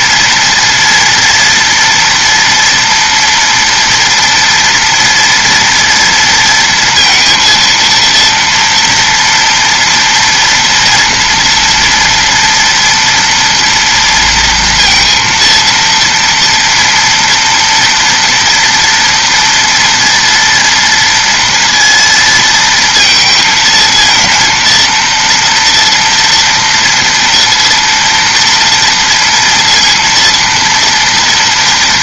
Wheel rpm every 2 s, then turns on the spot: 230, 230, 230, 230, 230, 230, 230, 230, 230, 230, 230, 230, 230, 230, 230, 230.
none